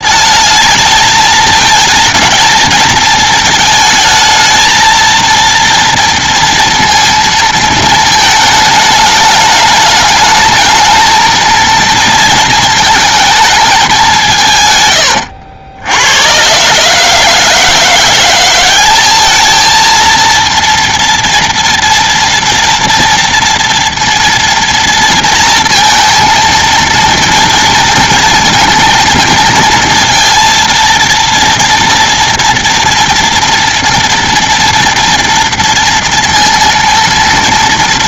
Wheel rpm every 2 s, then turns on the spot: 220, 220, 220, 230, 210, 220, 220, 120, 150, 200, 230, 230, 230, 230, 230, 230, 230, 240, 230.
none